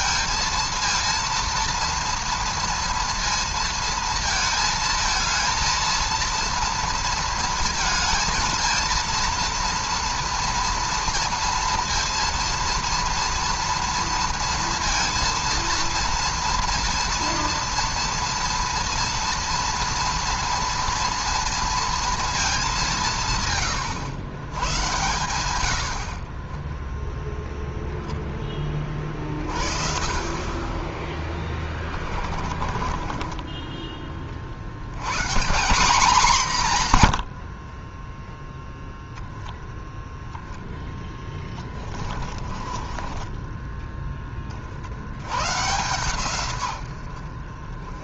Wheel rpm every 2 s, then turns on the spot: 230, 230, 220, 230, 230, 240, 230, 230, 230, 230, 230, 200, 100, 40, 20, 30, 30, 50, 170, 10, 10, 30, 40, 110.
26-28 32-34 42-44